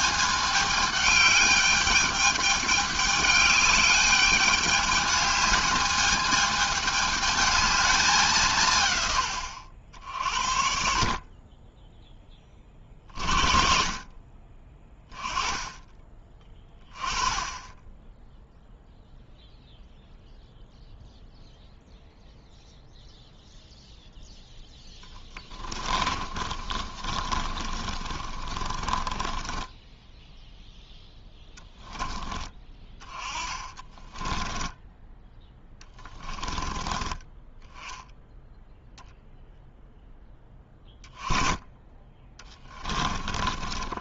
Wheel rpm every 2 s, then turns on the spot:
210, 210, 210, 220, 110, 40, 40, 20, 20, 0, 0, 0, 10, 30, 20, 0, 20, 10, 10, 0, 10, 20.
24-30 32-34 42-44